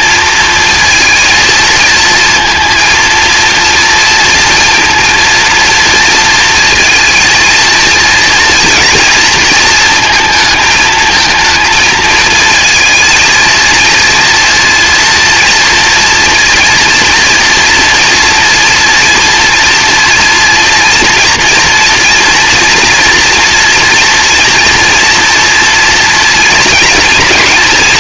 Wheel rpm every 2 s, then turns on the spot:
230, 230, 230, 230, 230, 220, 230, 230, 230, 230, 230, 240, 230, 230.
none